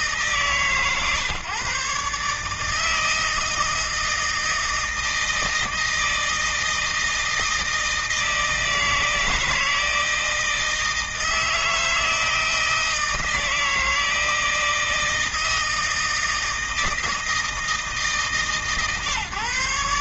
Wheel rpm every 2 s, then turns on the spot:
150, 160, 160, 160, 160, 160, 160, 160, 160, 150.
none